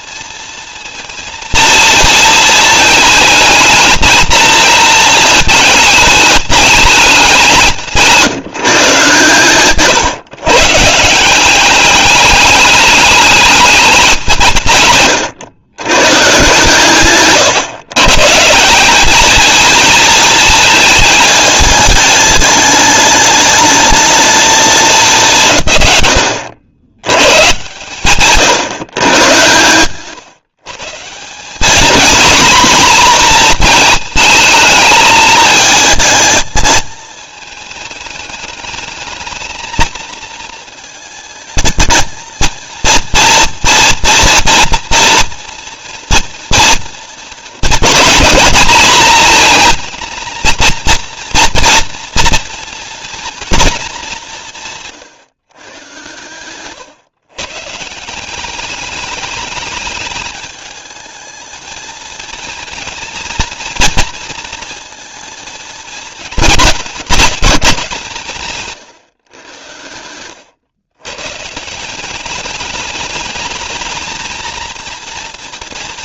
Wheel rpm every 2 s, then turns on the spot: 230, 220, 220, 210, 150, 150, 210, 130, 130, 180, 220, 210, 210, 90, 140, 150, 240, 220, 220, 210, 220, 230, 240, 230, 230, 230, 230, 160, 130, 200, 220, 230, 230, 210, 140, 110, 210, 230.
none